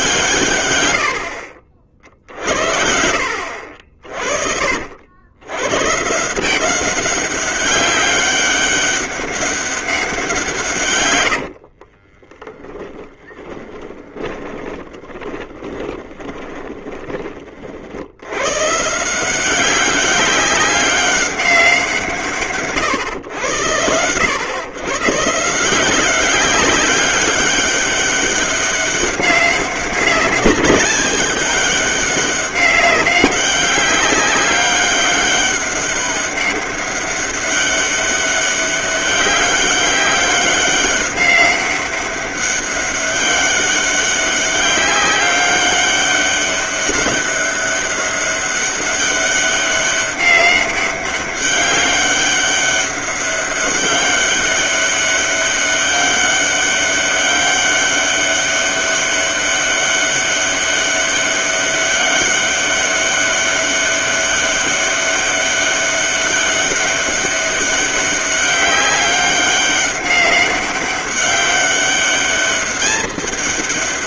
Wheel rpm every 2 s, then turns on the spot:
120, 60, 60, 180, 200, 130, 30, 20, 20, 150, 200, 130, 120, 200, 190, 200, 200, 200, 200, 200, 200, 200, 190, 200, 200, 200, 200, 200, 200, 200, 200, 200, 200, 200, 200, 200, 200.
12-18